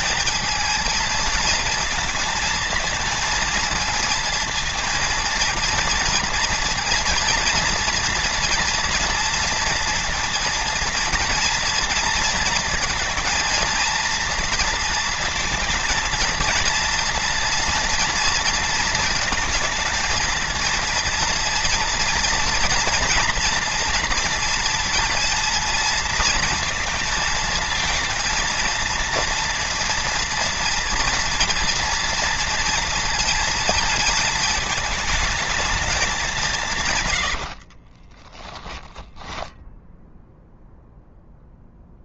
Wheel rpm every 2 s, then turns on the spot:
220, 230, 230, 230, 230, 230, 230, 230, 230, 230, 230, 230, 230, 230, 230, 230, 230, 210, 160, 10, 0.
none